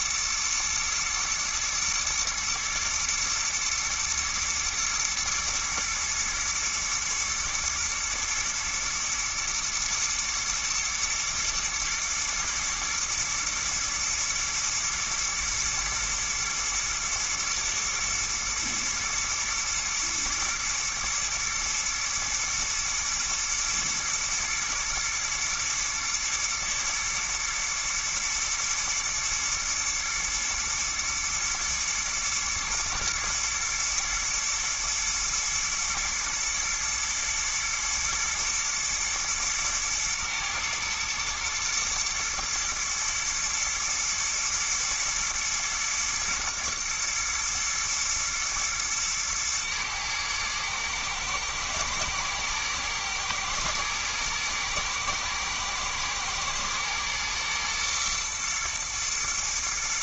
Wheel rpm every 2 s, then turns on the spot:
110, 120, 110, 110, 110, 110, 120, 110, 110, 120, 110, 120, 120, 110, 110, 110, 110, 120, 110, 110, 110, 120, 110, 120, 110, 110, 110, 110, 110, 120.
none